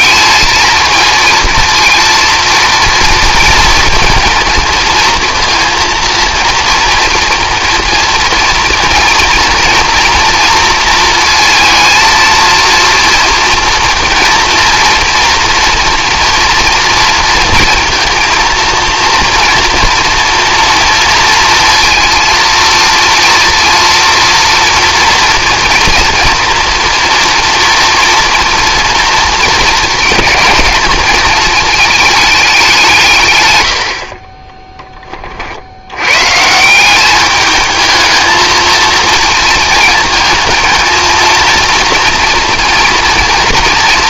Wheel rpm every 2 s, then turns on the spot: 220, 230, 230, 230, 230, 230, 230, 230, 230, 230, 230, 230, 230, 230, 230, 220, 190, 20, 160, 230, 230, 230.
34-36